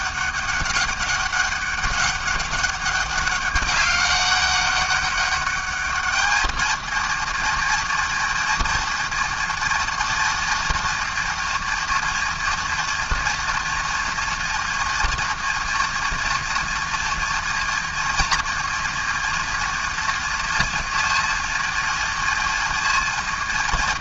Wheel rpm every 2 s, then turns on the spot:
200, 200, 200, 220, 230, 230, 230, 230, 230, 230, 230, 230.
none